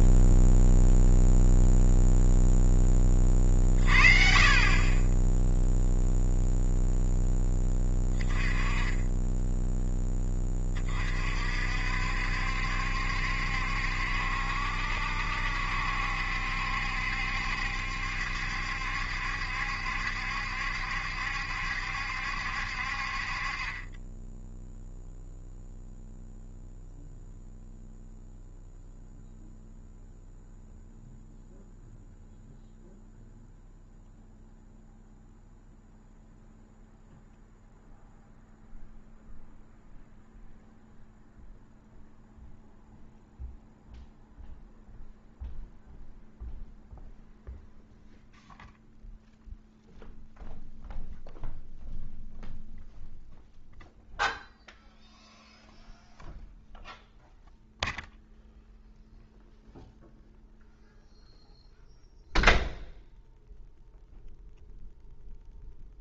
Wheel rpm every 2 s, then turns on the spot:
0, 10, 40, 0, 20, 40, 70, 70, 70, 70, 70, 60, 0, 0, 0, 0, 0, 0, 0, 0, 0, 0, 0, 0, 0, 0, 0, 0, 0, 0, 0, 0, 0.
none